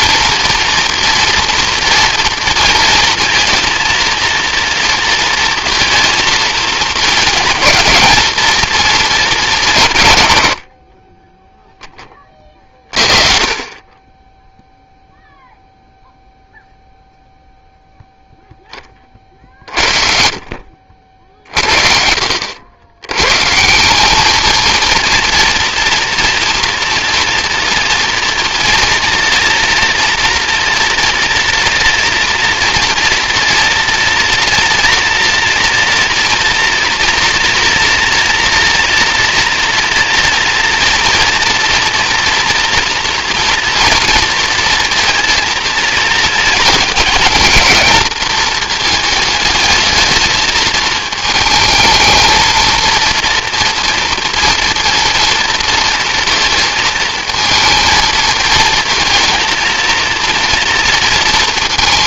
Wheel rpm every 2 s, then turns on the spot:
230, 230, 230, 230, 190, 10, 30, 0, 0, 40, 50, 170, 230, 230, 230, 230, 240, 230, 230, 230, 230, 230, 220, 210, 220, 220, 230, 230, 220, 230, 220.
none